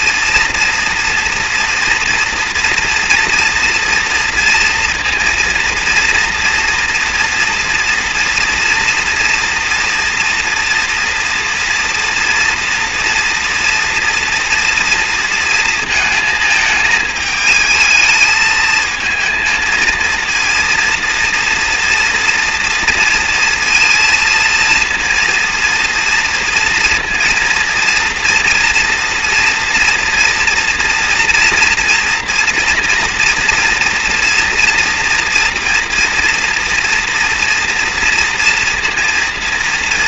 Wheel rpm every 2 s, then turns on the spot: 240, 230, 230, 230, 230, 240, 230, 230, 220, 220, 230, 230, 230, 230, 240, 240, 230, 230, 230, 240.
none